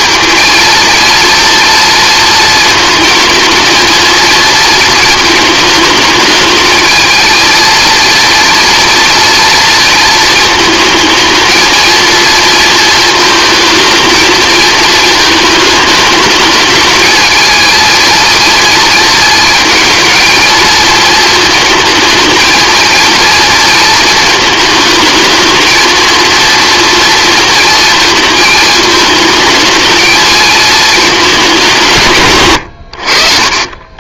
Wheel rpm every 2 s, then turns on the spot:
230, 230, 230, 210, 230, 220, 230, 220, 220, 230, 230, 230, 220, 230, 220, 220, 100.
none